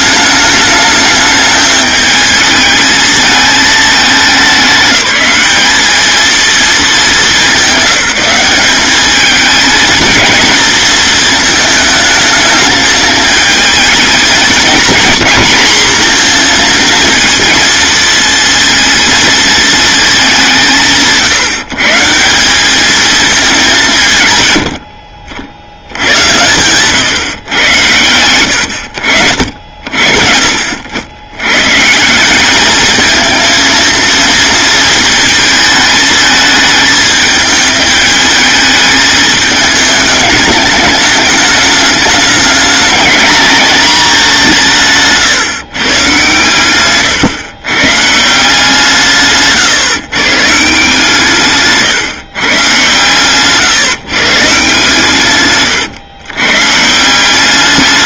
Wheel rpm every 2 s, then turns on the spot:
210, 220, 200, 210, 200, 220, 220, 230, 230, 230, 160, 210, 60, 130, 80, 90, 220, 230, 220, 220, 210, 210, 160, 130, 160, 160, 130, 130, 150.
44-46